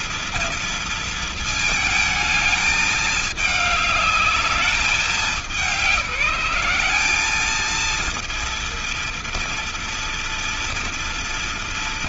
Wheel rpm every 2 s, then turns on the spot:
230, 210, 210, 200, 230, 230.
none